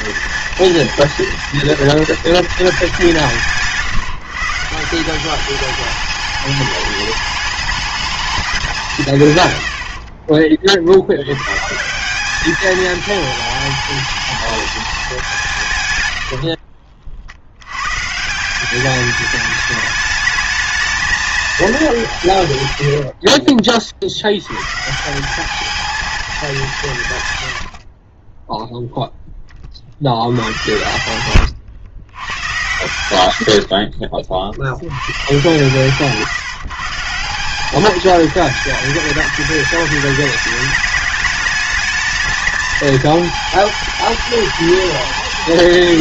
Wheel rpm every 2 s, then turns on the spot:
230, 180, 160, 210, 200, 40, 210, 220, 60, 180, 220, 100, 120, 190, 10, 90, 110, 70, 140, 220, 210, 220, 210.
16-18